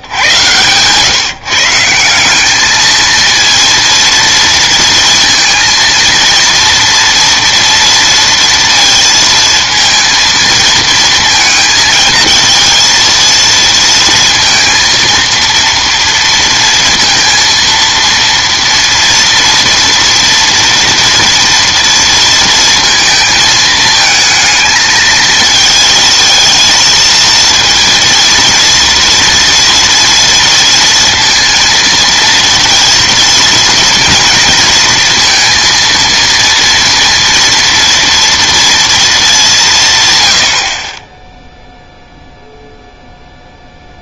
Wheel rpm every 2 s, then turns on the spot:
130, 220, 230, 230, 230, 230, 230, 230, 230, 230, 230, 230, 220, 220, 230, 230, 230, 230, 230, 230, 30, 0.
none